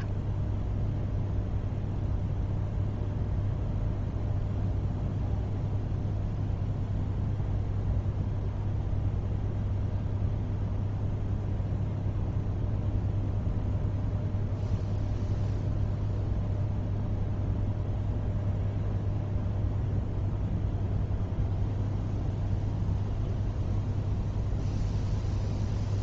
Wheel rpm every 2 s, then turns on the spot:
0, 0, 0, 0, 0, 0, 0, 0, 0, 0, 0, 0, 0.
none